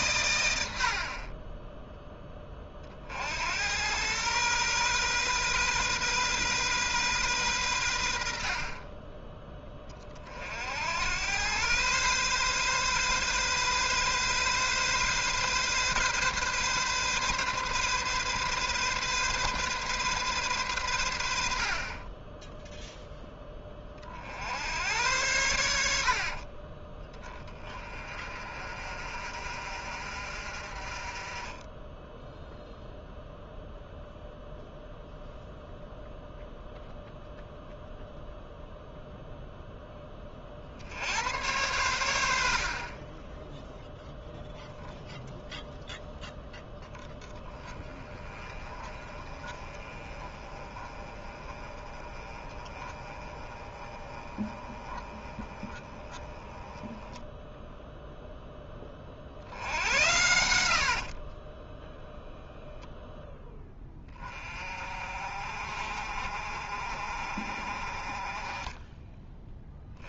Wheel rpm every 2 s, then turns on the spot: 80, 30, 130, 130, 30, 70, 130, 130, 130, 130, 110, 0, 80, 20, 40, 40, 0, 0, 0, 0, 60, 50, 0, 10, 30, 30, 30, 20, 10, 20, 70, 0, 40, 50, 20.
42-44 60-62 68-70